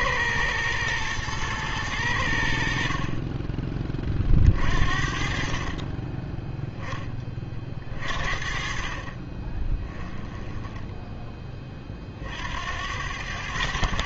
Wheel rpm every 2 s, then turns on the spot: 110, 60, 50, 10, 40, 10, 80.
none